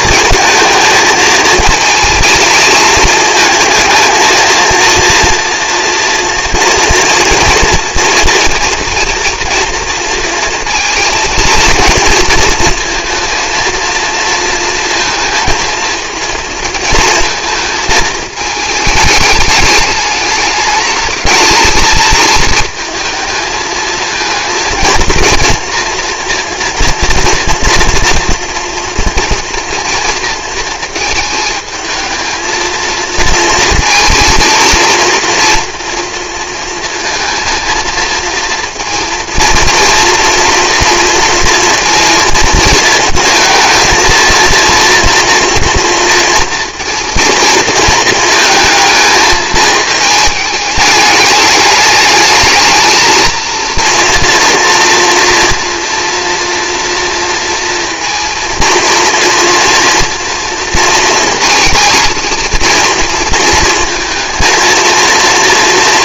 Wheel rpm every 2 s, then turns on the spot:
220, 220, 230, 240, 230, 230, 230, 230, 220, 220, 220, 220, 230, 230, 230, 230, 230, 230, 230, 230, 230, 230, 230, 230, 220, 210, 220, 230, 230, 230, 230, 230, 230.
none